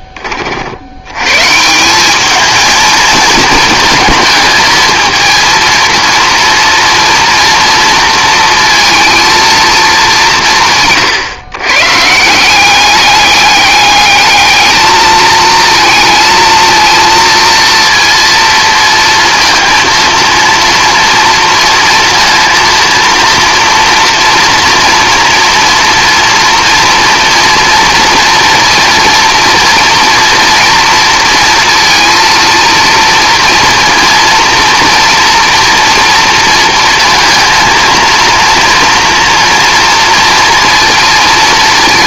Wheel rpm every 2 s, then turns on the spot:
40, 220, 220, 230, 230, 180, 180, 210, 230, 230, 230, 230, 230, 230, 230, 230, 230, 230, 230, 230, 230.
none